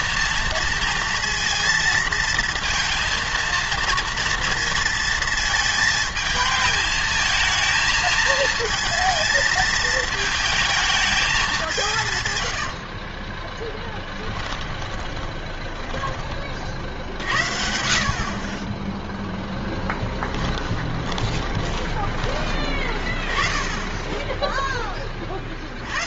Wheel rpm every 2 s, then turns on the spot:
230, 230, 230, 220, 230, 220, 80, 20, 50, 20, 20, 20, 10.
12-16 20-22